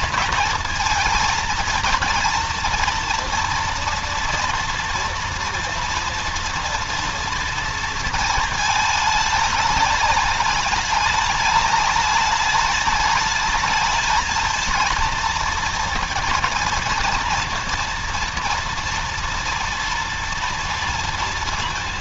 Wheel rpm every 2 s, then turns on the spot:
230, 230, 240, 230, 220, 210, 210, 220, 230, 230, 230.
none